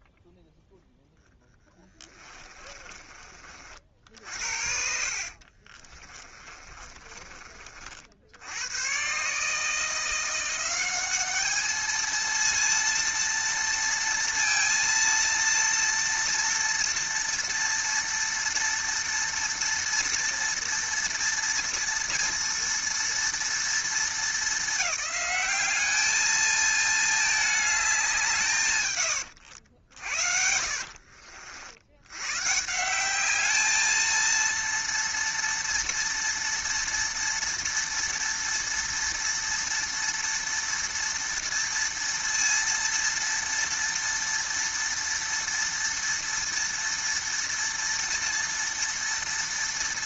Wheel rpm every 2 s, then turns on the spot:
0, 20, 50, 30, 80, 180, 230, 230, 230, 240, 230, 230, 210, 220, 150, 60, 140, 230, 230, 230, 230, 230, 230, 230, 230.
2-8 30-32